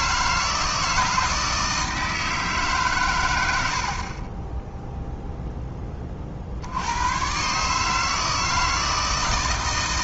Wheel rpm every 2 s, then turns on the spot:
160, 130, 0, 80, 160.
none